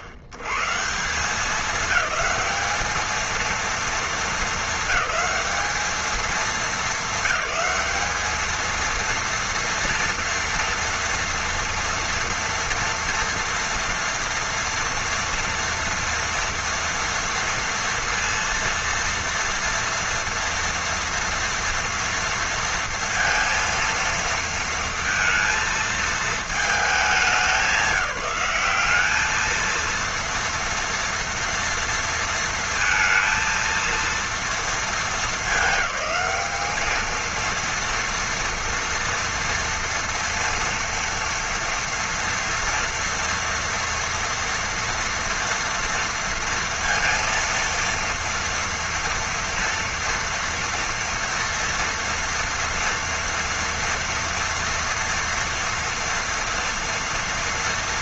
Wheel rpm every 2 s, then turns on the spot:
100, 210, 220, 220, 220, 240, 230, 230, 230, 230, 230, 230, 230, 220, 190, 230, 230, 230, 210, 230, 240, 230, 230, 230, 230, 230, 230, 230, 230.
none